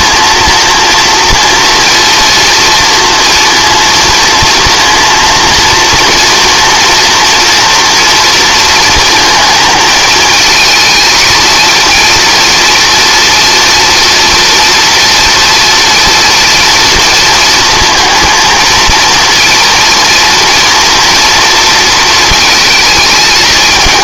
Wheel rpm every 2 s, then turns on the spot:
230, 230, 230, 230, 230, 220, 230, 230, 230, 230, 230, 220.
none